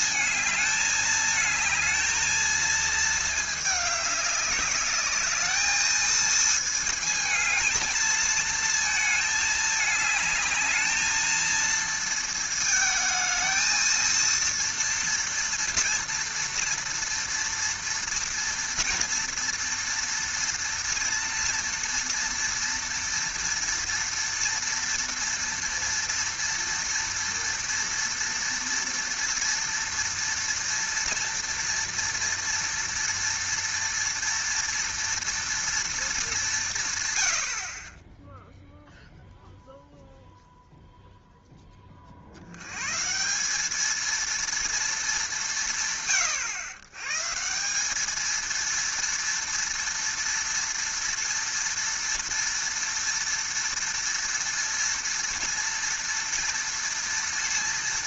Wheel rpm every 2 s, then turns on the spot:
220, 220, 200, 220, 220, 210, 220, 230, 230, 230, 230, 230, 240, 230, 230, 230, 230, 230, 170, 0, 0, 110, 230, 120, 230, 230, 230, 230, 230.
none